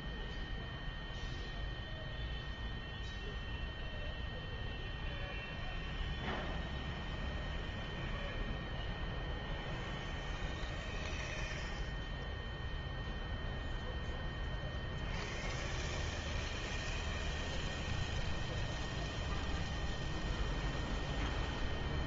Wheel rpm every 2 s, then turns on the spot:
0, 0, 0, 0, 0, 0, 0, 0, 0, 0, 0.
none